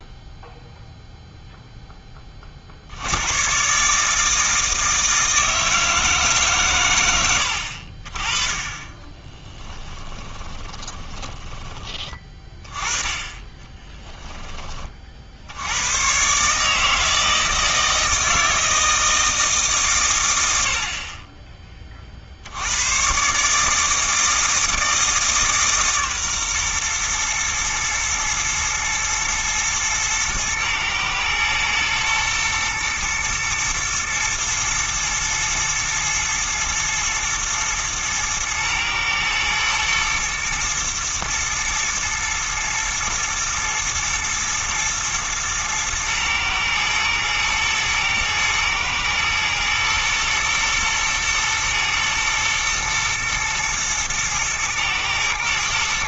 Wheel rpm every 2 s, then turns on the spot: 0, 70, 160, 120, 20, 20, 20, 30, 150, 160, 70, 100, 160, 120, 120, 110, 120, 120, 110, 110, 120, 110, 110, 110, 110, 110, 110, 110.
10-12